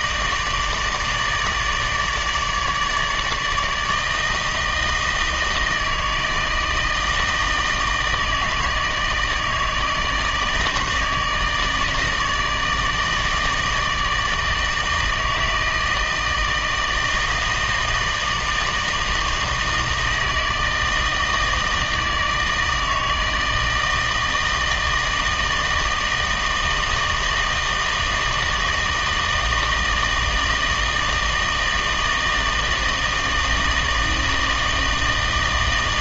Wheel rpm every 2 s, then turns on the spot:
160, 150, 160, 160, 160, 160, 160, 160, 160, 160, 160, 160, 160, 160, 160, 160, 160, 160.
none